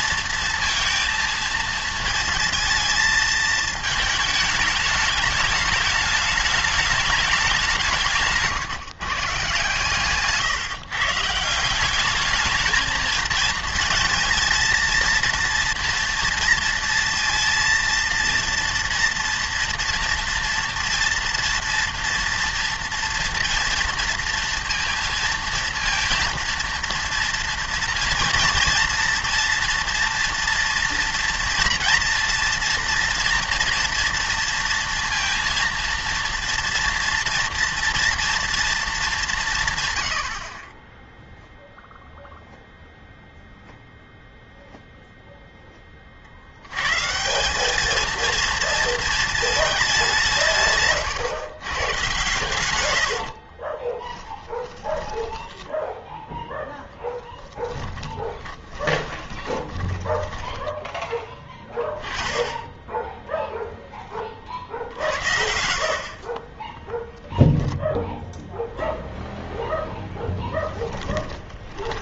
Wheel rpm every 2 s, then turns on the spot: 230, 220, 210, 210, 150, 150, 220, 220, 230, 230, 230, 230, 230, 230, 230, 230, 230, 230, 230, 230, 30, 0, 0, 90, 230, 150, 120, 30, 10, 30, 20, 10, 50, 10, 0, 10.
52-56 58-62 70-72